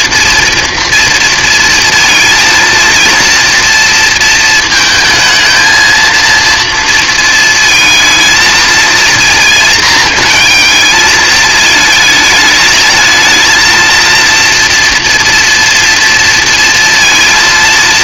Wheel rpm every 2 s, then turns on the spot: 230, 230, 220, 230, 220, 220, 220, 240, 230.
none